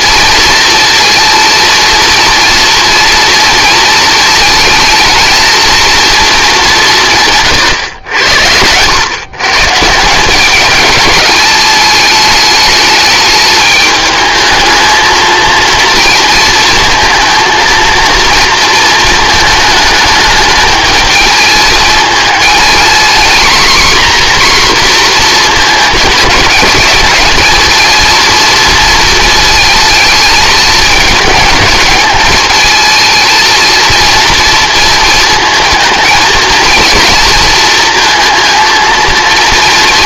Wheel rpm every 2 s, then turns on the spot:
230, 230, 220, 190, 100, 210, 210, 220, 230, 230, 220, 230, 250, 220, 230, 210, 220, 230, 230, 230.
none